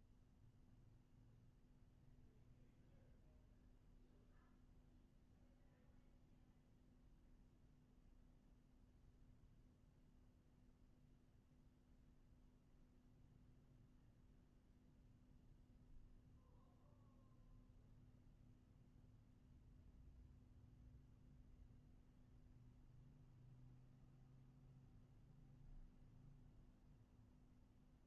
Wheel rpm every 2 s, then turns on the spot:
0, 0, 0, 0, 0, 0, 0, 0, 0, 0, 0, 0, 0, 0.
none